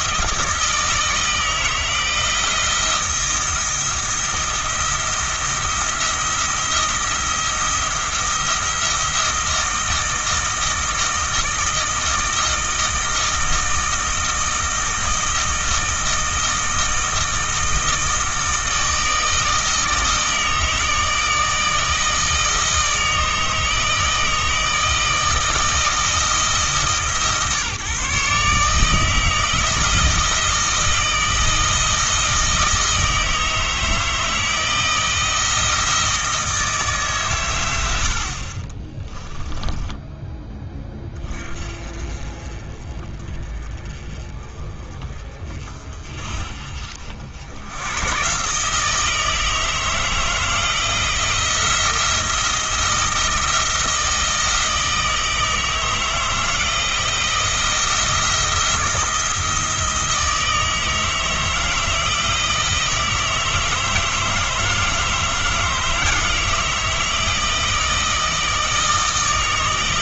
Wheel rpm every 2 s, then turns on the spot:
160, 170, 170, 170, 170, 160, 160, 160, 160, 160, 160, 160, 160, 150, 150, 160, 160, 160, 150, 30, 20, 30, 30, 50, 150, 160, 160, 160, 170, 170, 160, 160, 160, 160, 160.
38-40